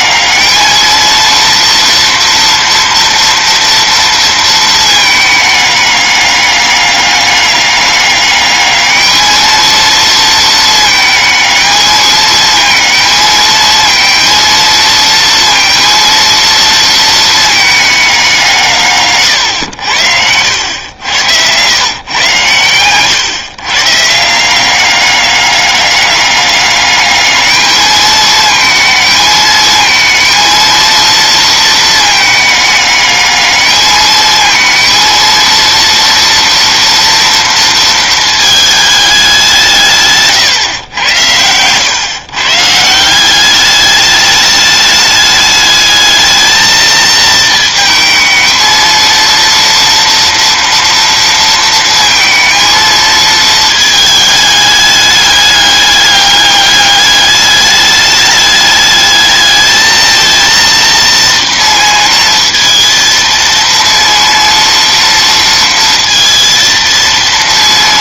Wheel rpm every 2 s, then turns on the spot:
220, 240, 230, 200, 210, 220, 220, 230, 230, 160, 90, 130, 180, 200, 220, 230, 210, 220, 230, 220, 130, 160, 210, 220, 220, 230, 230, 210, 200, 210, 230, 230, 230, 230.
20-22 40-42